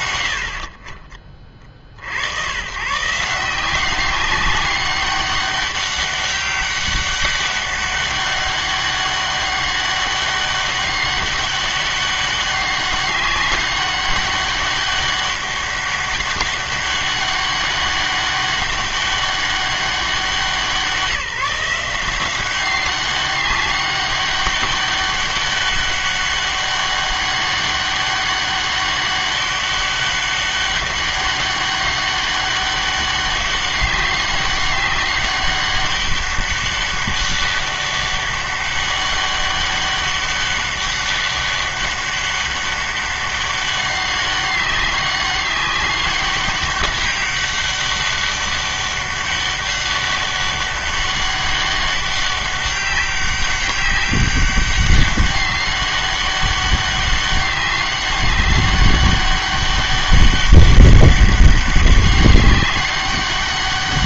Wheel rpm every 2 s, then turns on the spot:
50, 110, 190, 200, 200, 200, 200, 200, 200, 200, 180, 190, 200, 200, 200, 200, 200, 200, 200, 200, 200, 200, 200, 200, 200, 200, 200, 200, 200, 200, 200, 200.
none